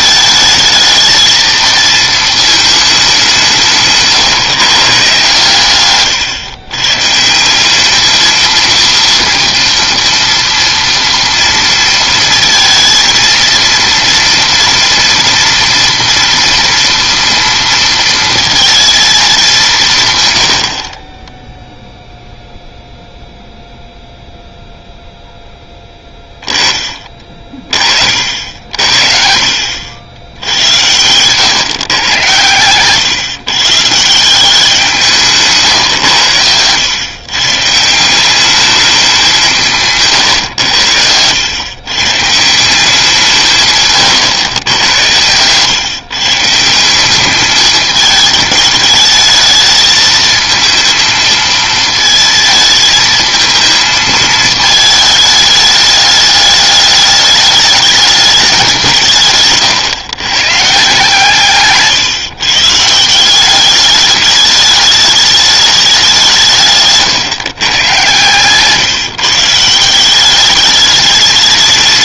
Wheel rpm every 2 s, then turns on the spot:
220, 220, 140, 130, 230, 240, 230, 230, 230, 230, 90, 0, 0, 20, 60, 90, 110, 170, 100, 200, 110, 160, 110, 160, 220, 220, 220, 220, 210, 190, 140, 150, 210, 160, 130, 200.
32-34 68-70